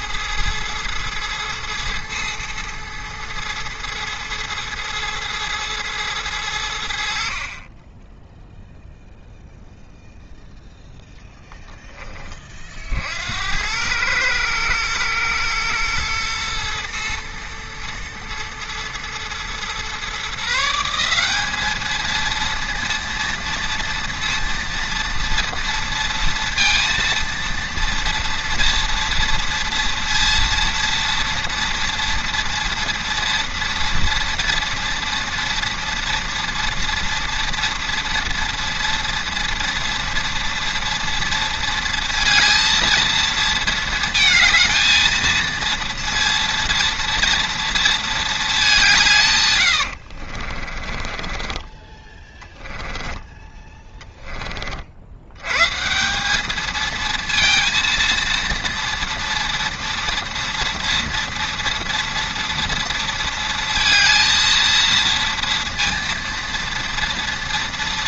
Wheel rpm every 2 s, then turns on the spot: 110, 110, 110, 70, 0, 0, 50, 110, 120, 110, 180, 230, 230, 230, 230, 230, 230, 230, 230, 240, 230, 230, 230, 230, 170, 30, 10, 60, 220, 230, 230, 230, 230, 230.
50-54